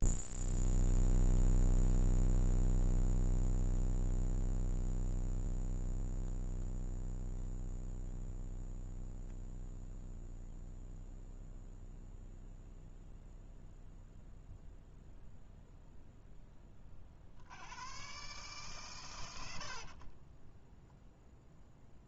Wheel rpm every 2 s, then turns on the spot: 0, 0, 0, 0, 0, 0, 0, 0, 10, 140, 0.
none